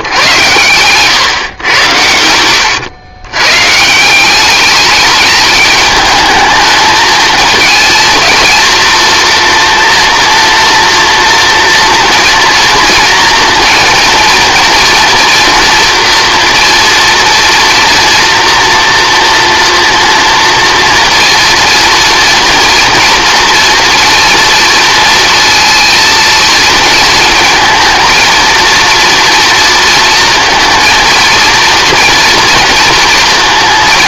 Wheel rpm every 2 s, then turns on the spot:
130, 100, 210, 220, 230, 230, 230, 240, 230, 230, 230, 230, 230, 220, 230, 230, 230.
none